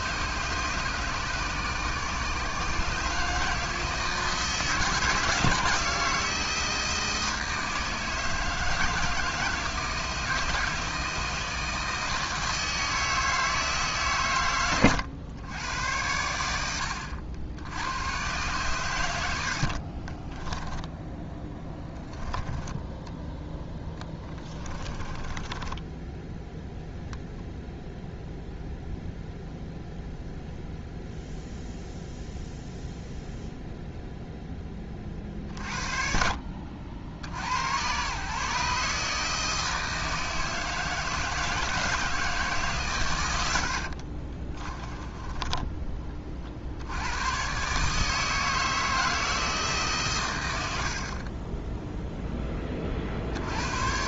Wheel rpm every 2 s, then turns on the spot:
150, 150, 170, 160, 160, 160, 160, 100, 80, 100, 10, 10, 30, 0, 0, 0, 0, 30, 70, 150, 160, 120, 20, 90, 160, 60, 40.
24-26 44-46